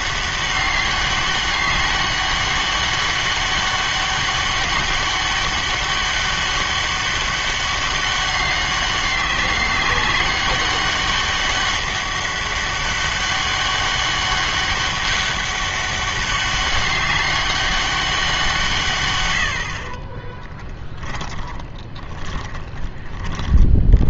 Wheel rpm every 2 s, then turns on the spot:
190, 200, 200, 200, 190, 200, 200, 200, 200, 170, 10, 30.
20-24